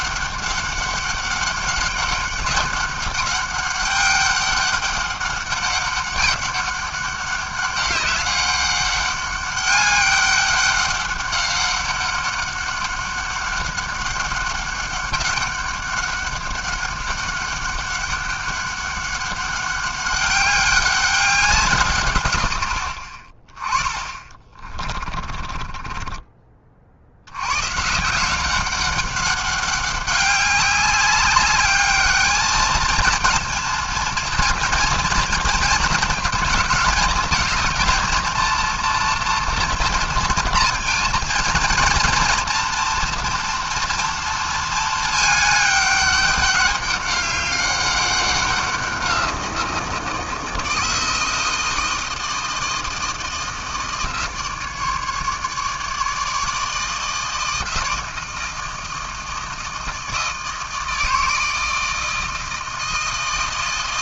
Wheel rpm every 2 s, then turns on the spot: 200, 200, 200, 200, 200, 200, 200, 200, 200, 200, 190, 30, 20, 90, 200, 200, 230, 230, 220, 230, 230, 230, 210, 200, 180, 160, 160, 150, 160, 160, 160, 160.
24-26